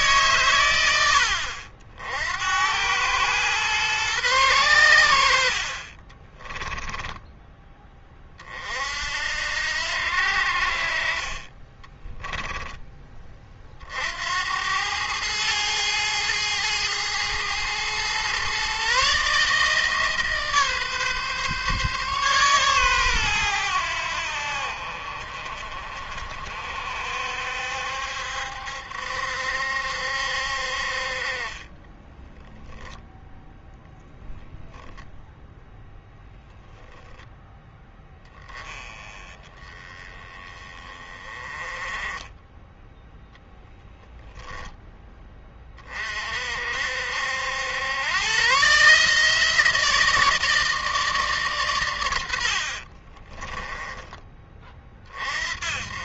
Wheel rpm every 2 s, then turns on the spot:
110, 90, 100, 10, 50, 50, 10, 90, 110, 130, 140, 130, 60, 60, 70, 50, 0, 0, 10, 20, 20, 10, 10, 60, 140, 160, 50, 30.
6-8 52-54